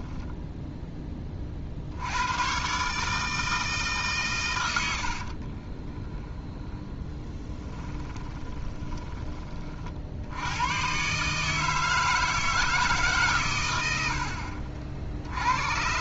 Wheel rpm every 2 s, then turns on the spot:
10, 140, 80, 10, 20, 120, 160, 60.
6-10